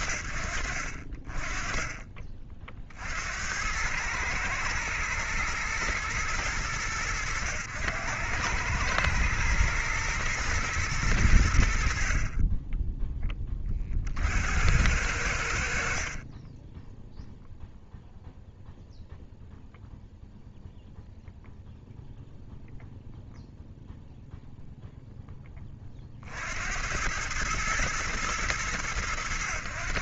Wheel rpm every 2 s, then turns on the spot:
40, 110, 100, 110, 110, 30, 80, 20, 0, 0, 0, 0, 50, 110, 100.
none